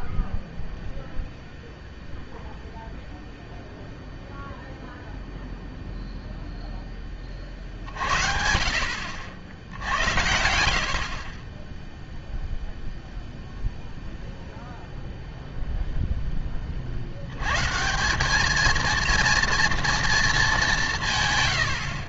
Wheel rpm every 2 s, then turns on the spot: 0, 0, 0, 0, 50, 80, 0, 0, 10, 220, 190.
none